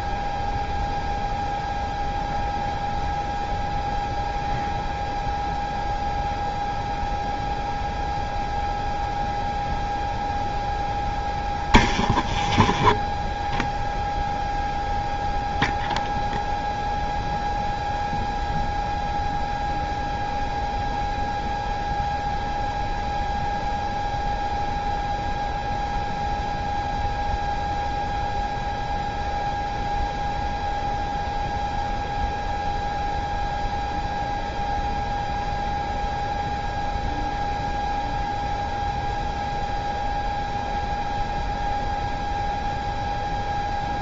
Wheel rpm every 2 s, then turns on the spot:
0, 0, 0, 0, 0, 0, 0, 0, 0, 0, 0, 0, 0, 0, 0, 0, 0, 0, 0, 0, 0, 0.
none